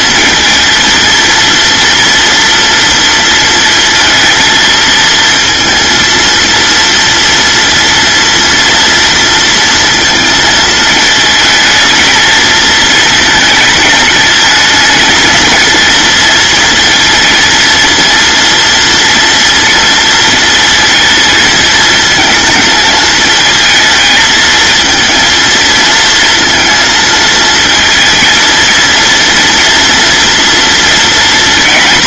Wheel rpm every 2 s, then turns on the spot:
230, 230, 220, 230, 230, 220, 220, 220, 230, 240, 230, 220, 220, 230, 230, 230.
none